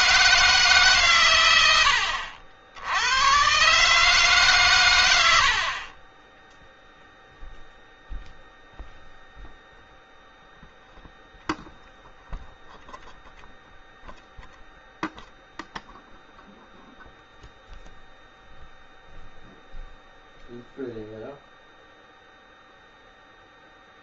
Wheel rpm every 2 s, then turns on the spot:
140, 90, 110, 0, 0, 0, 0, 0, 0, 0, 0, 0.
none